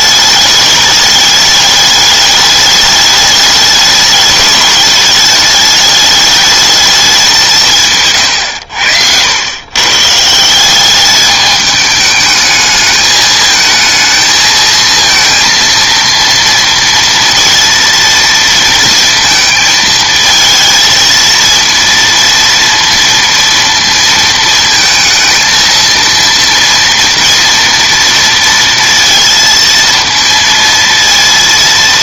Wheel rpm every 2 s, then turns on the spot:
210, 210, 210, 210, 100, 180, 210, 220, 230, 230, 220, 230, 220, 230, 230, 230.
8-10